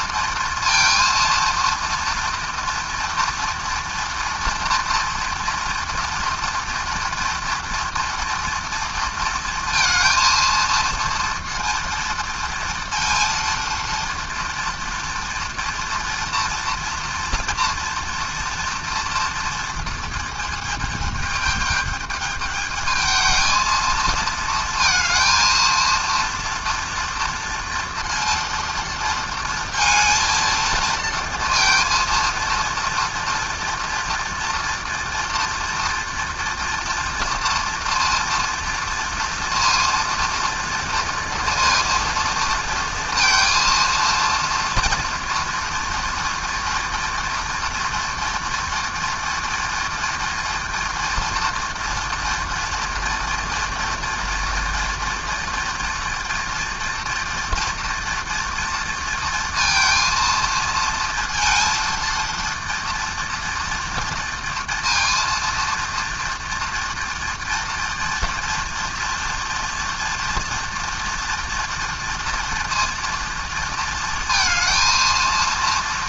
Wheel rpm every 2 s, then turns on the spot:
230, 230, 230, 230, 230, 230, 230, 230, 230, 240, 220, 210, 230, 230, 230, 230, 230, 230, 230, 230, 230, 230, 230, 240, 240, 240, 230, 230, 230, 230, 230, 230, 230, 230, 240, 240, 230, 230.
none